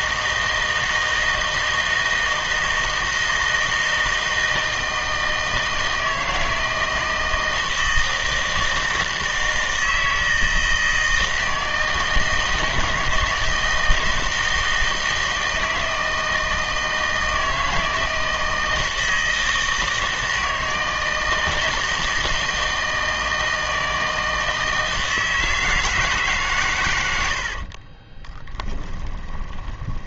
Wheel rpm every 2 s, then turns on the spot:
160, 160, 160, 160, 160, 160, 160, 160, 160, 160, 160, 160, 160, 130, 10.
28-30